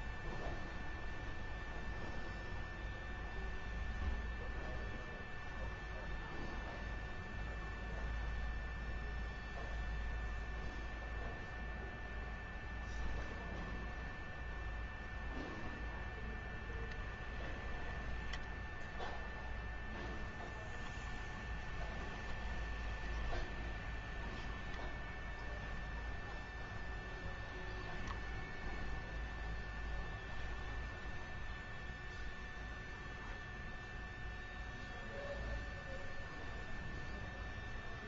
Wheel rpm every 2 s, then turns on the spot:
0, 0, 0, 0, 0, 0, 0, 0, 10, 0, 10, 10, 10, 0, 0, 0, 0, 0, 0.
16-18 22-24